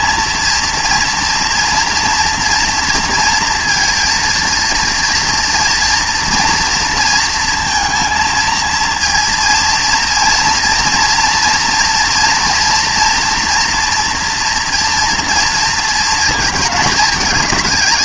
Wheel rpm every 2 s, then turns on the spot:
230, 230, 230, 230, 230, 230, 230, 230, 220.
none